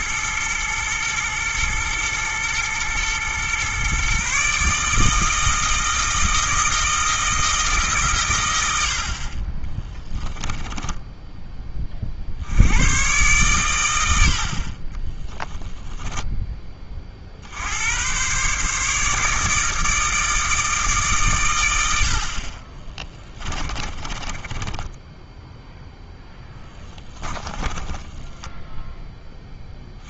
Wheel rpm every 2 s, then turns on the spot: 110, 110, 150, 160, 80, 10, 100, 50, 30, 150, 150, 20, 10, 10, 0.
10-12 22-28